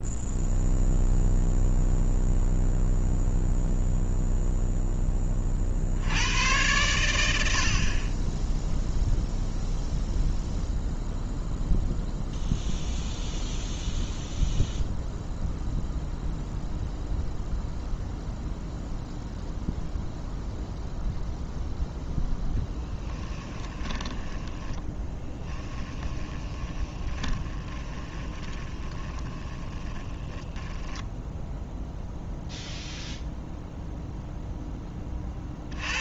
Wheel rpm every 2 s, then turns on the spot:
0, 0, 10, 100, 0, 0, 0, 0, 0, 0, 0, 10, 20, 20, 20, 10, 0, 10.
22-32